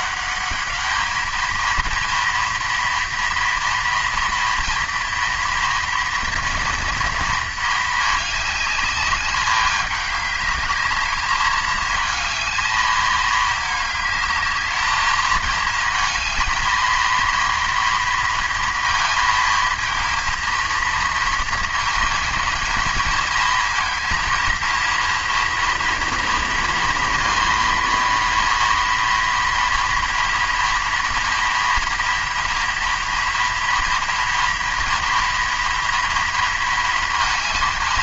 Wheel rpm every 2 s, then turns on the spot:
210, 230, 230, 230, 210, 210, 220, 210, 220, 230, 230, 220, 230, 230, 230, 230, 230, 230, 230.
none